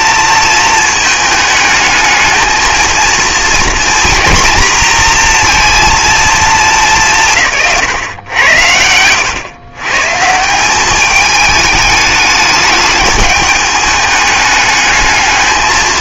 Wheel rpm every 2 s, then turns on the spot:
220, 220, 230, 200, 90, 190, 210, 210.
none